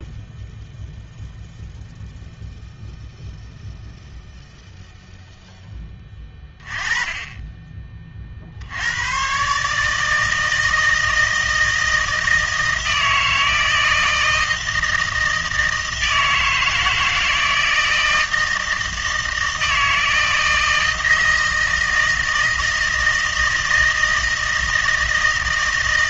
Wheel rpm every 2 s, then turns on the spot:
0, 0, 0, 20, 80, 160, 160, 160, 160, 160, 160, 160, 160.
none